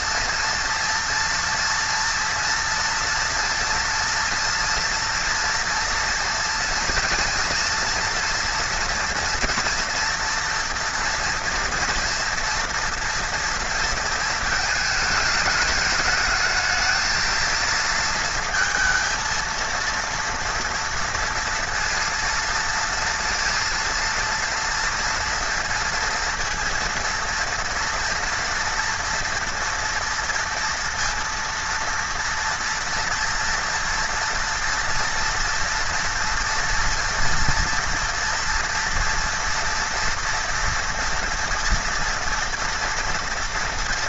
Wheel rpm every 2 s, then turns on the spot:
230, 230, 230, 230, 230, 230, 230, 220, 220, 230, 230, 230, 230, 230, 230, 230, 230, 230, 240, 230, 230, 230.
none